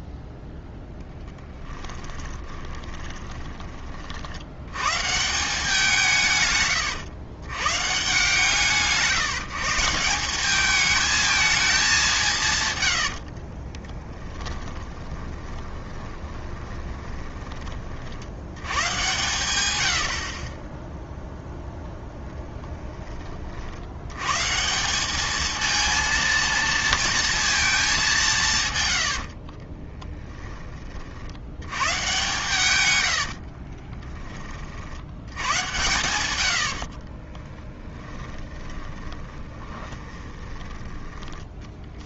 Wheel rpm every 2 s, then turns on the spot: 0, 20, 100, 140, 160, 210, 130, 10, 20, 110, 20, 10, 170, 230, 130, 20, 110, 40, 70, 20, 20.
2-4 14-18 36-42